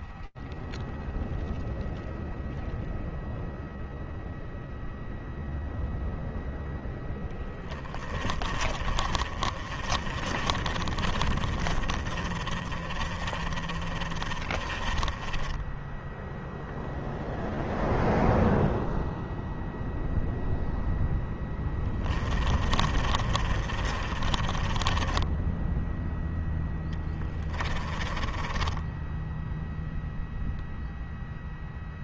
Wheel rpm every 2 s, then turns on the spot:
0, 0, 0, 10, 30, 30, 30, 10, 0, 0, 10, 30, 0, 10, 0, 0.
6-16 20-24 26-28